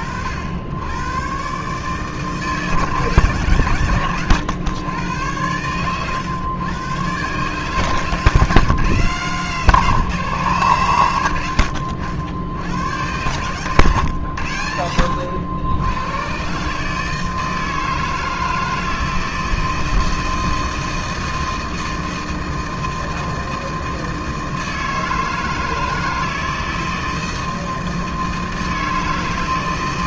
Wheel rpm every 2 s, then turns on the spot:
90, 150, 110, 120, 150, 130, 90, 90, 150, 160, 160, 160, 160, 160, 160.
none